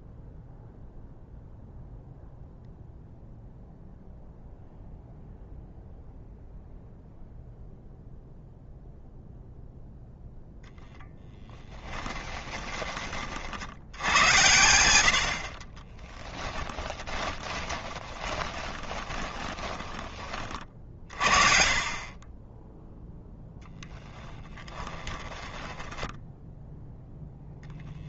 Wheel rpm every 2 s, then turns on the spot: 0, 0, 0, 0, 0, 0, 30, 90, 20, 20, 50, 10, 20, 0.
16-20 24-26